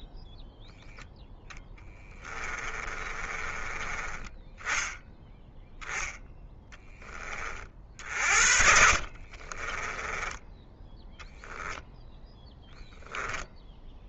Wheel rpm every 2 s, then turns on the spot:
10, 20, 10, 0, 50, 10, 0.
0-4 8-10